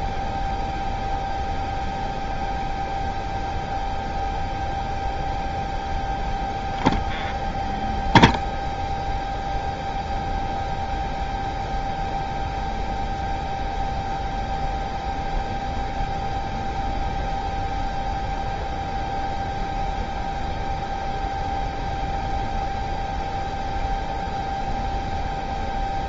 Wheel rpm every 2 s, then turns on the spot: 0, 0, 0, 0, 0, 0, 0, 0, 0, 0, 0, 0, 0.
none